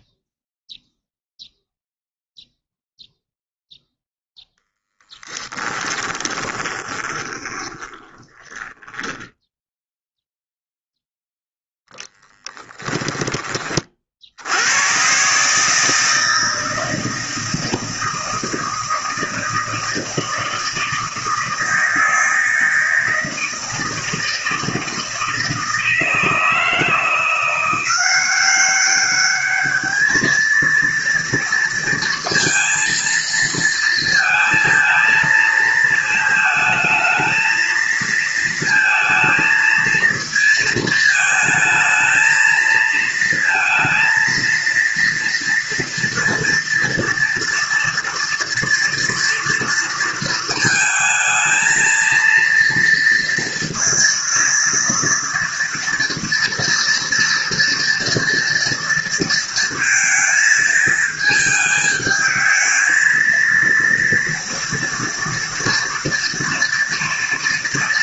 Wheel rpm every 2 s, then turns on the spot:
0, 0, 10, 20, 10, 0, 20, 120, 160, 160, 160, 160, 160, 170, 200, 230, 230, 220, 220, 230, 220, 220, 230, 230, 230, 220, 230, 230, 230, 230, 220, 220, 230, 230.
4-10 12-14